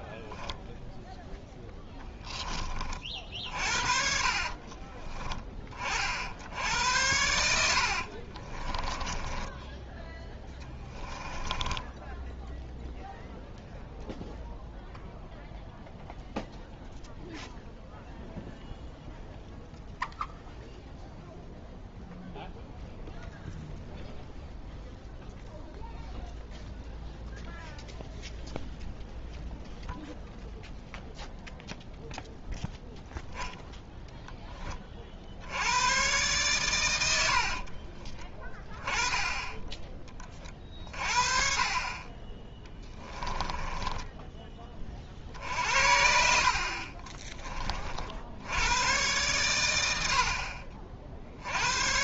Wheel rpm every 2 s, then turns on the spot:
0, 30, 30, 80, 20, 10, 0, 0, 0, 0, 0, 0, 0, 0, 0, 0, 0, 30, 110, 10, 30, 10, 30, 50, 90, 50.
4-6 8-10 42-44